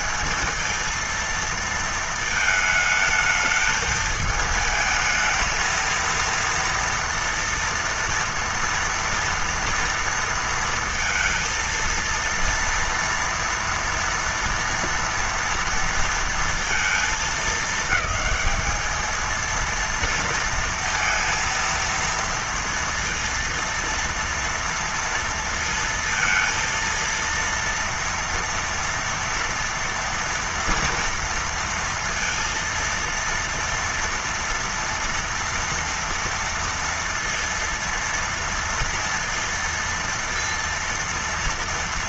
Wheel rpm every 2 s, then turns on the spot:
220, 220, 220, 230, 230, 230, 230, 230, 220, 220, 230, 230, 230, 230, 230, 230, 230, 230, 230, 230, 230.
none